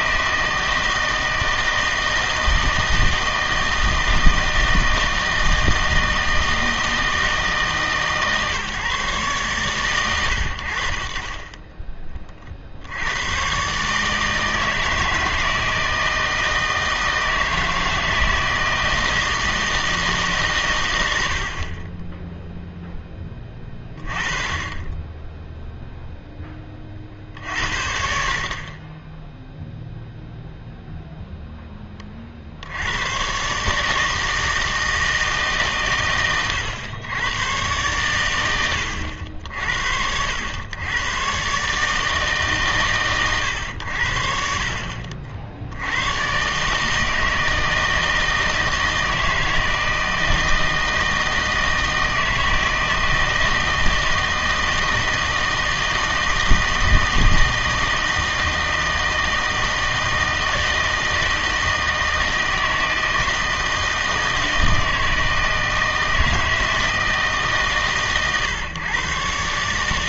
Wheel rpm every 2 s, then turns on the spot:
160, 160, 160, 160, 140, 60, 60, 160, 160, 160, 130, 0, 20, 30, 30, 0, 70, 160, 110, 80, 100, 140, 60, 140, 160, 160, 160, 160, 160, 160, 160, 160, 160, 160, 120.
none